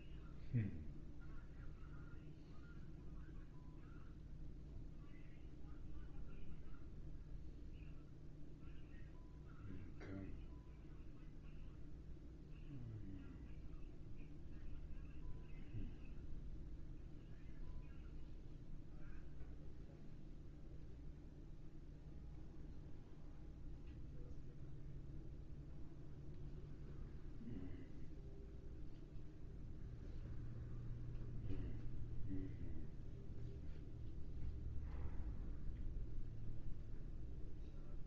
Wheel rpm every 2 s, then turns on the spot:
0, 0, 0, 0, 0, 0, 0, 0, 0, 0, 0, 0, 0, 0, 0, 0, 0, 0, 0.
none